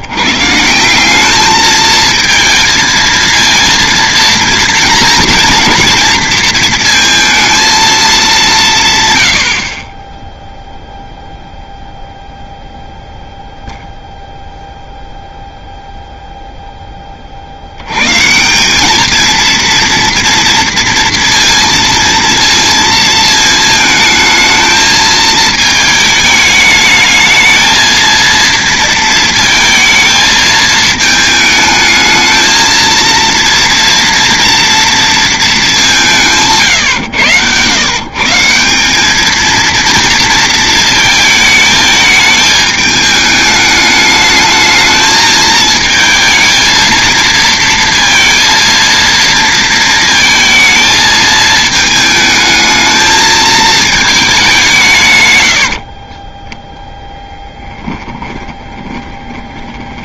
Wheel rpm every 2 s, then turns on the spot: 170, 220, 240, 230, 150, 0, 0, 0, 10, 190, 240, 230, 220, 210, 230, 220, 230, 230, 140, 190, 220, 210, 220, 230, 230, 220, 220, 180, 0, 20.
58-60